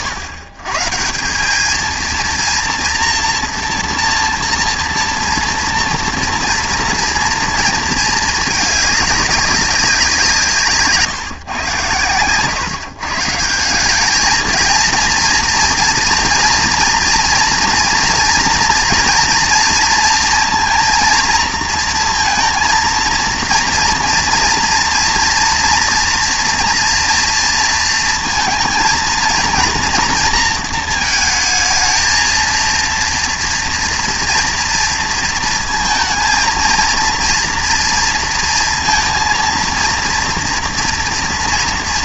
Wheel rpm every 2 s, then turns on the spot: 120, 230, 230, 230, 210, 160, 130, 230, 230, 230, 230, 230, 230, 230, 230, 230, 230, 230, 230, 230, 230.
none